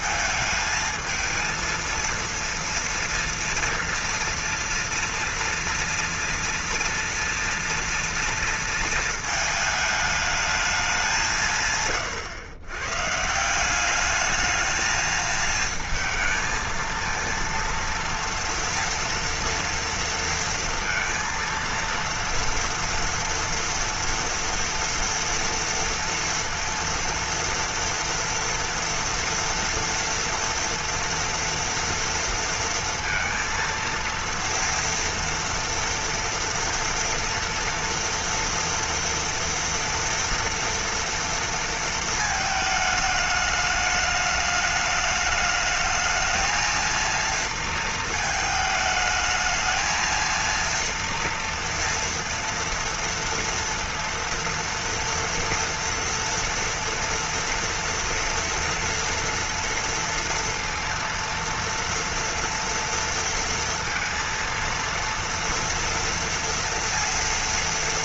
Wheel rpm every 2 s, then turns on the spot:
220, 230, 230, 230, 230, 210, 110, 220, 230, 230, 230, 230, 230, 230, 240, 230, 230, 230, 230, 230, 230, 220, 210, 220, 220, 230, 230, 230, 230, 230, 230, 230, 230, 230.
none